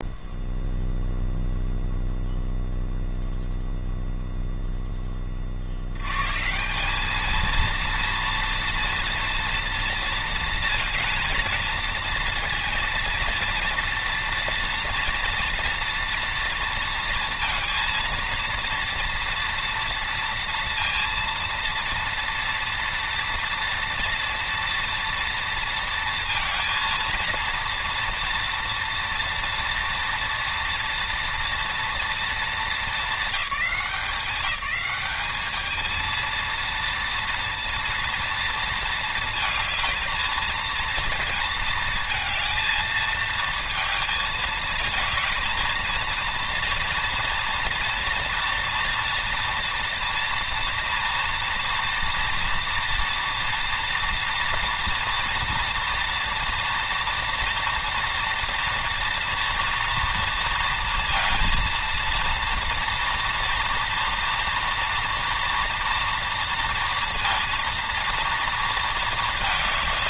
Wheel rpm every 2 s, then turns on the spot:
0, 0, 0, 140, 230, 230, 240, 230, 230, 230, 230, 230, 230, 230, 230, 230, 220, 190, 230, 230, 220, 220, 220, 230, 230, 230, 230, 230, 240, 230, 230, 230, 240, 230, 230.
none